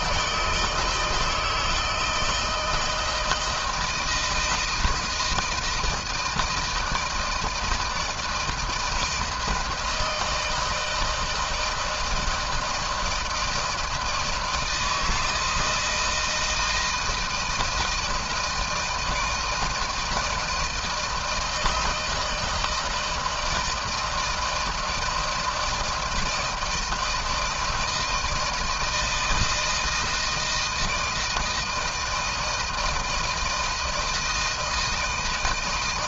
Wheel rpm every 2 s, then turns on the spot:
160, 160, 160, 160, 160, 160, 160, 160, 170, 160, 160, 160, 160, 160, 160, 160, 160, 160.
none